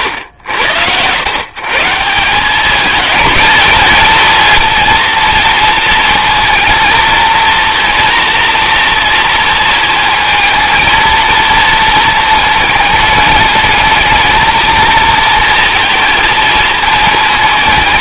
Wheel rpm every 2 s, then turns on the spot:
90, 200, 230, 230, 230, 220, 220, 220, 220.
none